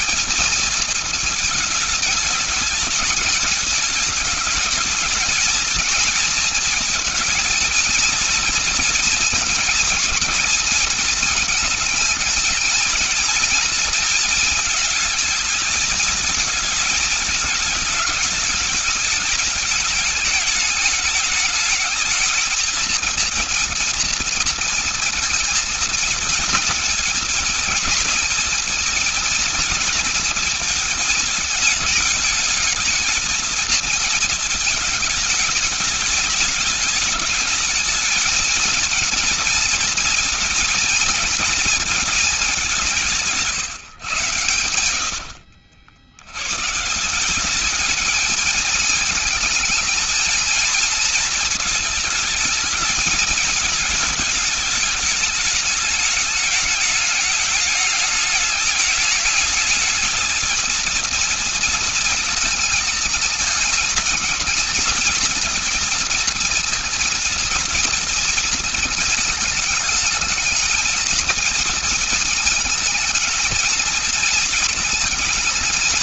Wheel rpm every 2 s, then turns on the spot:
220, 210, 230, 230, 230, 220, 230, 220, 220, 210, 210, 230, 230, 220, 230, 220, 230, 210, 210, 220, 220, 160, 60, 180, 220, 230, 220, 220, 210, 220, 230, 220, 230, 230, 220, 220, 220, 220.
44-46